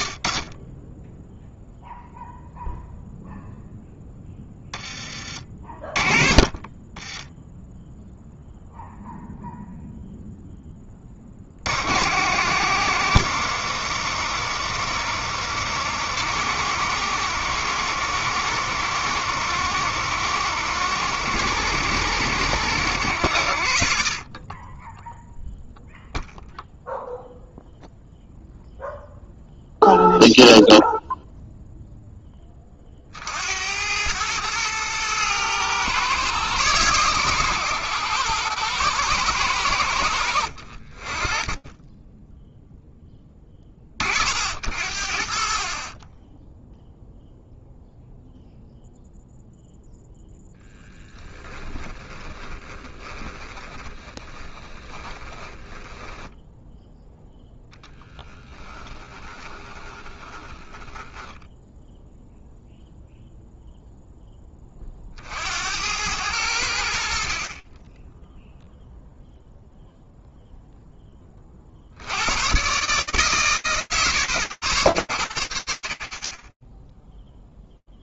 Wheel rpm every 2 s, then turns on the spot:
0, 0, 30, 10, 0, 60, 120, 120, 110, 110, 120, 40, 0, 0, 0, 0, 80, 120, 120, 110, 10, 10, 20, 0, 0, 10, 20, 20, 0, 10, 10, 0, 40, 50, 0, 40, 110, 70, 0.
6-8 50-56 58-60